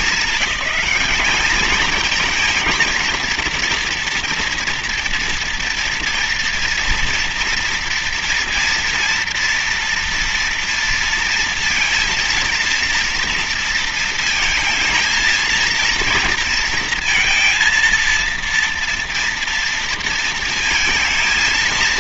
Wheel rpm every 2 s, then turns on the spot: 210, 230, 230, 230, 240, 230, 230, 230, 230, 230, 230.
none